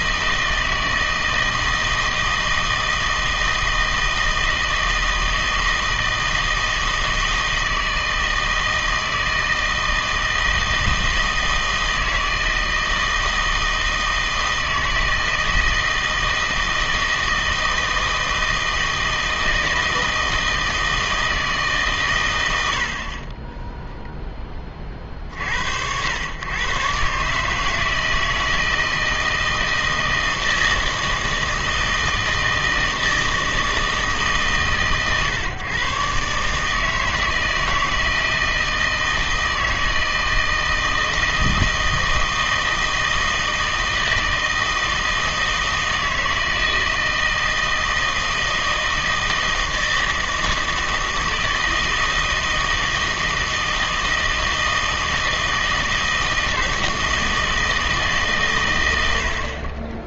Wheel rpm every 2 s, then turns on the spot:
160, 160, 160, 160, 160, 160, 160, 160, 160, 160, 160, 70, 30, 110, 160, 160, 160, 140, 150, 160, 160, 160, 160, 160, 160, 160, 160, 160, 160, 110.
none